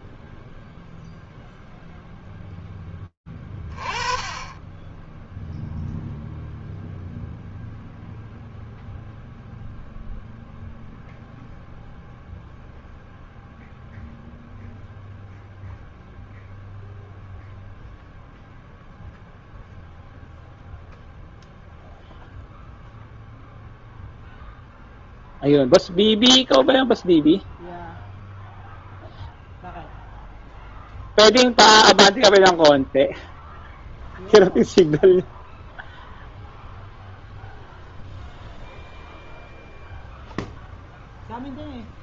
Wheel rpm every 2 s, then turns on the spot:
20, 0, 0, 0, 0, 0, 0, 0, 0, 0, 0, 0, 0, 0, 0, 0, 0, 0, 0, 0, 0.
none